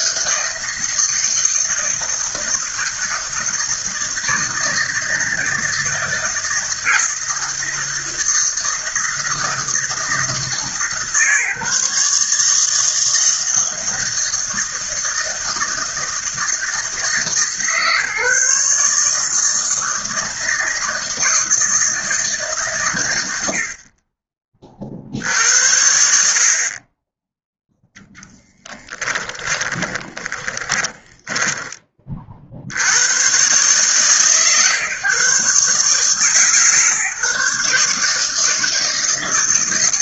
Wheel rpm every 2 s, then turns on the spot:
160, 160, 160, 160, 160, 150, 160, 160, 160, 150, 160, 120, 50, 20, 10, 10, 90, 130, 140, 160.
28-32